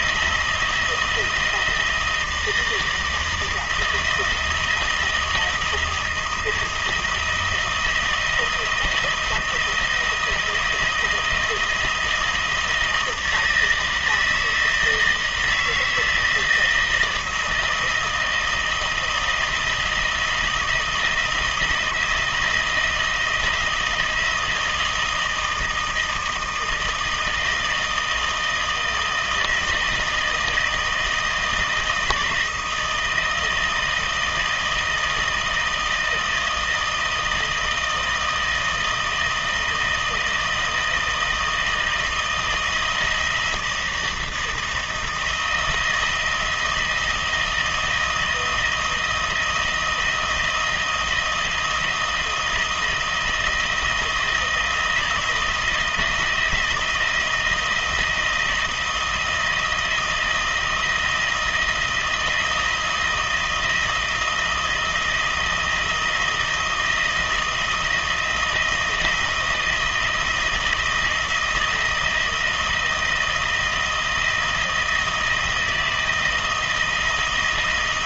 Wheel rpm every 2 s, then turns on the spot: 170, 170, 160, 170, 160, 170, 160, 160, 160, 170, 160, 160, 170, 160, 160, 160, 160, 160, 160, 160, 160, 160, 170, 170, 160, 170, 160, 160, 160, 160, 160, 160, 160, 160, 160, 160, 170, 160, 160.
none